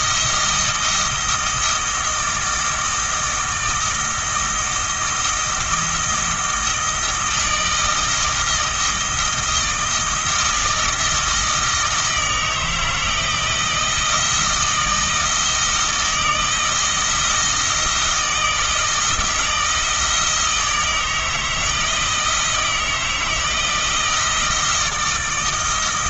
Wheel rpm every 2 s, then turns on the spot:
160, 160, 170, 160, 160, 160, 160, 160, 160, 160, 160, 160, 160.
none